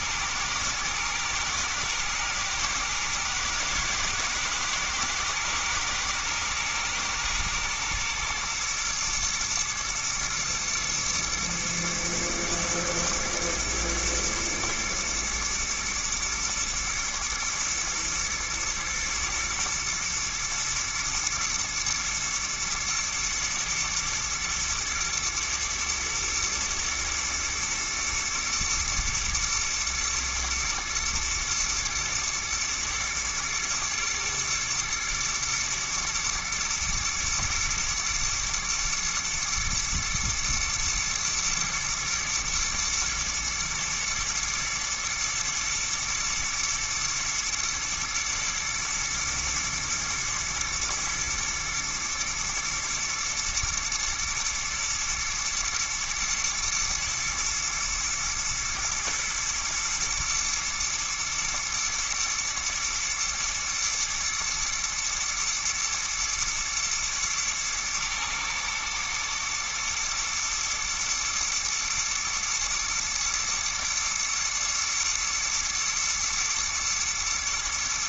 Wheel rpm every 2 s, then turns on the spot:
110, 110, 110, 120, 110, 120, 120, 120, 110, 120, 110, 120, 110, 110, 110, 120, 120, 110, 110, 110, 110, 120, 120, 120, 110, 120, 120, 120, 110, 110, 110, 120, 120, 110, 110, 110, 120, 120, 110.
none